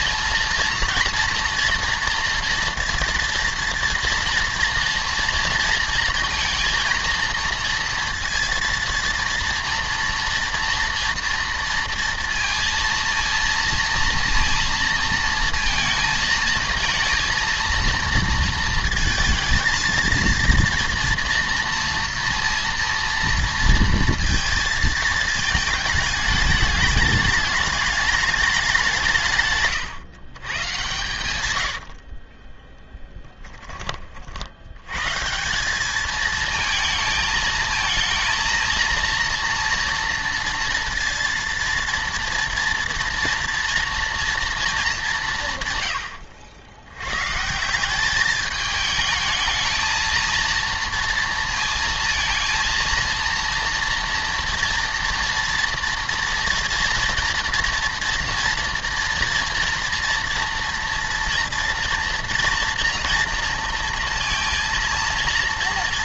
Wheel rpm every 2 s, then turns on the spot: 230, 230, 230, 230, 230, 240, 230, 230, 230, 230, 230, 230, 230, 210, 190, 130, 10, 90, 220, 230, 230, 230, 220, 80, 210, 230, 230, 230, 240, 240, 230, 230, 230.
32-34